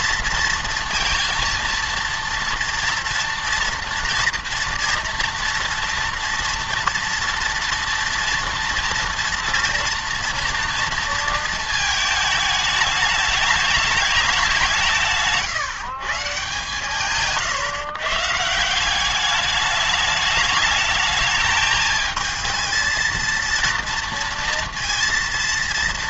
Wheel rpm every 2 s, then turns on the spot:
230, 230, 230, 230, 230, 230, 210, 170, 140, 170, 210, 220, 230.
none